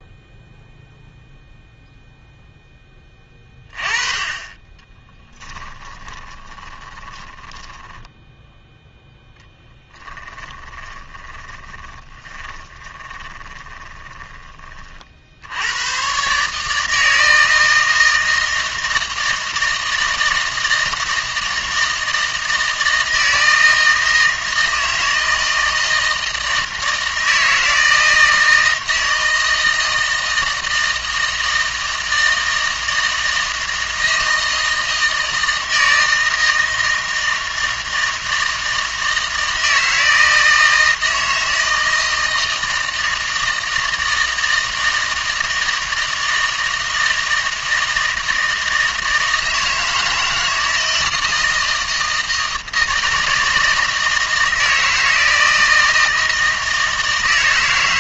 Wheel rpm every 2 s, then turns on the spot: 0, 10, 20, 20, 0, 10, 20, 30, 160, 160, 160, 160, 160, 160, 160, 160, 160, 160, 160, 160, 160, 160, 160, 160, 160, 160, 160, 160, 160.
4-8 10-14